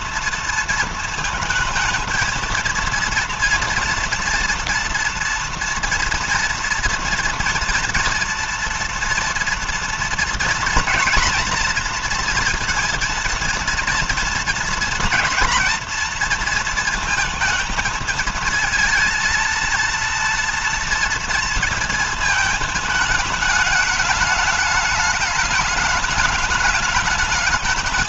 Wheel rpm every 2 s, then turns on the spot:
230, 230, 240, 230, 230, 230, 230, 230, 220, 230, 230, 210, 210, 210.
none